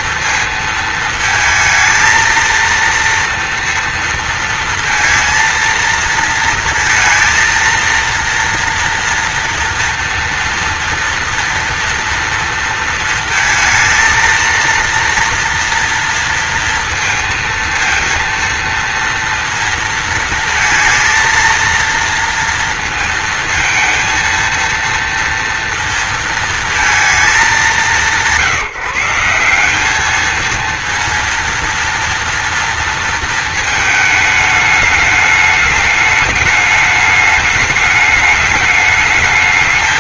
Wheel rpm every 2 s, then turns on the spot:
220, 230, 230, 230, 230, 230, 230, 230, 230, 230, 230, 220, 230, 210, 170, 230, 230, 210, 210, 220.
none